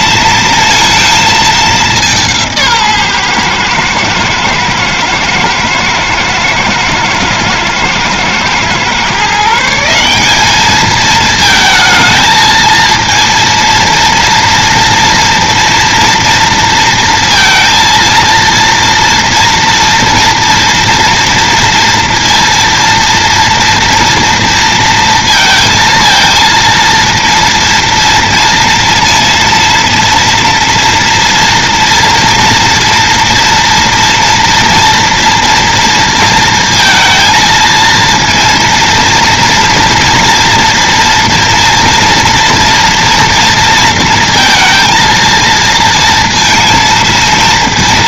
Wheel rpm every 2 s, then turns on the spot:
230, 160, 110, 110, 120, 210, 230, 230, 230, 230, 240, 230, 230, 230, 230, 230, 230, 230, 230, 230, 230, 240, 230, 230.
none